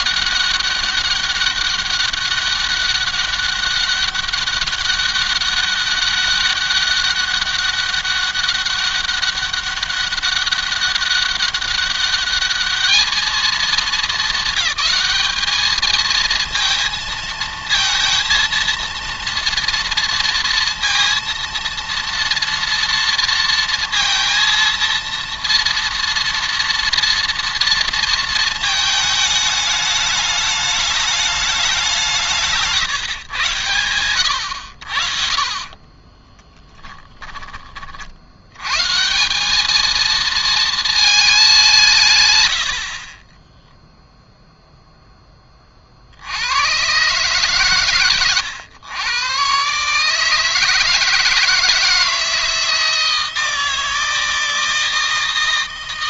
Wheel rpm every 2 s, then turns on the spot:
200, 200, 200, 200, 200, 200, 210, 220, 230, 230, 230, 230, 230, 230, 220, 210, 150, 80, 10, 120, 220, 50, 0, 110, 110, 160, 160, 160.
36-38